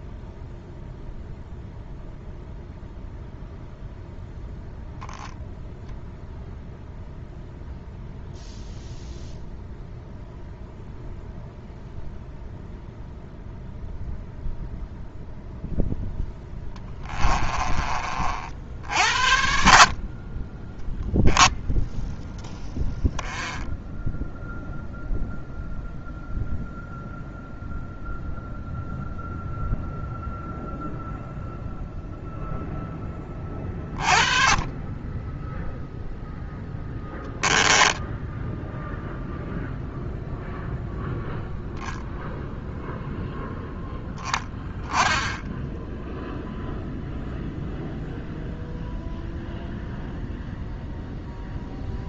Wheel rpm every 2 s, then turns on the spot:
0, 0, 0, 0, 0, 0, 0, 0, 20, 60, 10, 10, 0, 0, 0, 0, 10, 20, 0, 0, 0, 0, 10, 0, 0, 0.
16-18 20-22